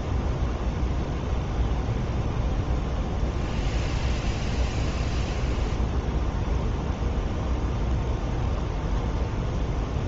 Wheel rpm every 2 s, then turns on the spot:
0, 0, 0, 0, 0.
none